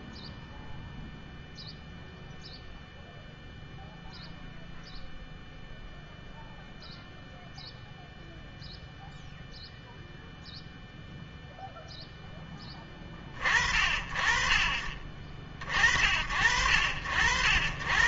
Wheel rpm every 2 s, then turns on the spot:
0, 0, 0, 0, 0, 0, 0, 50, 60.
none